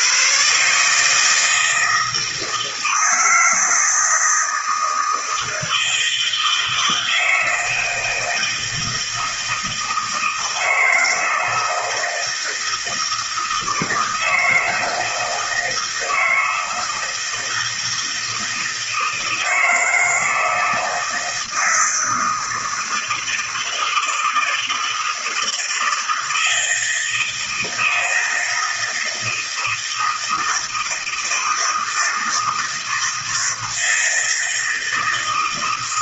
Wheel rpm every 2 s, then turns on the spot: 150, 160, 160, 160, 160, 160, 160, 160, 160, 160, 160, 160, 160, 160, 160, 160, 160, 160.
none